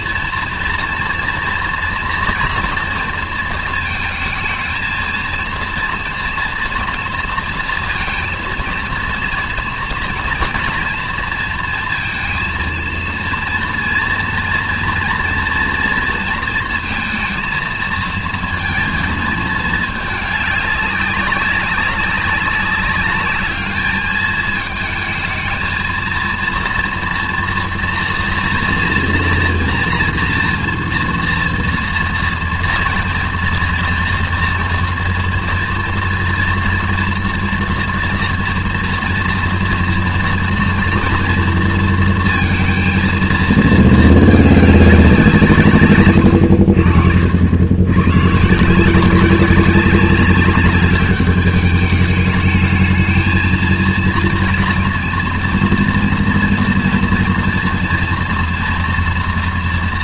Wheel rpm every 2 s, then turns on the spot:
230, 230, 230, 230, 230, 230, 230, 240, 230, 220, 200, 200, 220, 230, 230, 240, 240, 230, 230, 230, 240, 230, 210, 80, 160, 200, 210, 230, 230, 230.
none